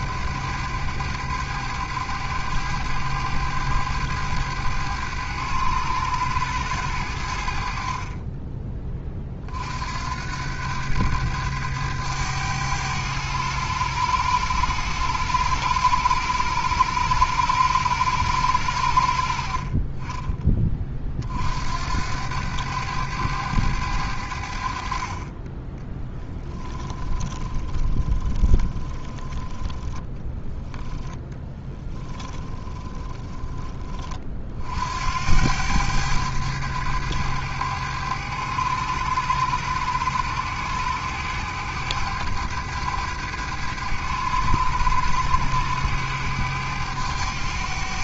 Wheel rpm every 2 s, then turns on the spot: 100, 100, 100, 90, 20, 100, 100, 100, 100, 70, 30, 100, 50, 20, 20, 10, 10, 60, 100, 100, 100, 100, 100, 100.
26-30 32-34